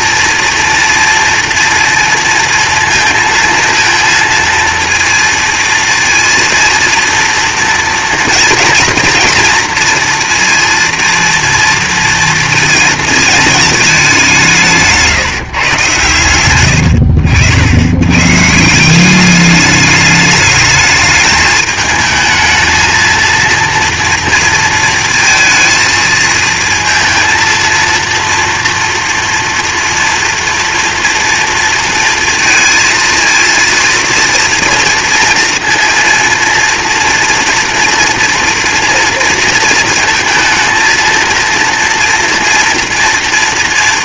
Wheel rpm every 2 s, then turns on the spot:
230, 230, 230, 230, 230, 230, 220, 170, 70, 190, 220, 230, 230, 230, 230, 230, 230, 230, 240, 230, 230, 230.
none